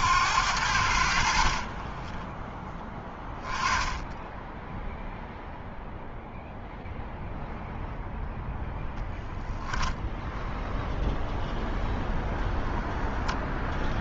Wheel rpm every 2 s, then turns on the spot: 70, 20, 10, 0, 0, 0, 0.
2-4